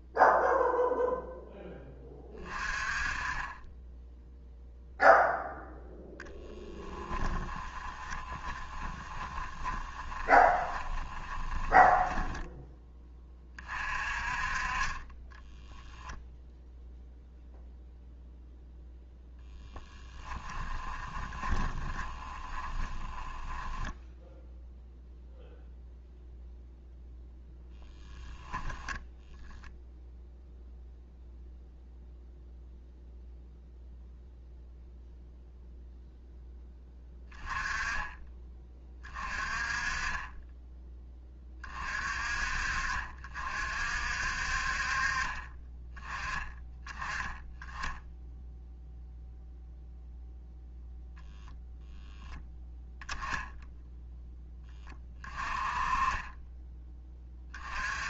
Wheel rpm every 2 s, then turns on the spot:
0, 20, 0, 10, 20, 20, 10, 30, 0, 0, 20, 10, 0, 0, 10, 0, 0, 0, 10, 20, 20, 50, 40, 10, 0, 0, 10, 20, 10.
6-12 20-24